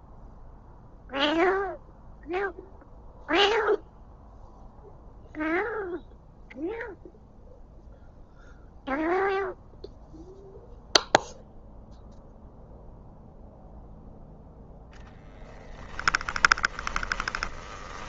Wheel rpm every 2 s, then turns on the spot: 0, 0, 0, 0, 0, 0, 0, 10, 20.
14-18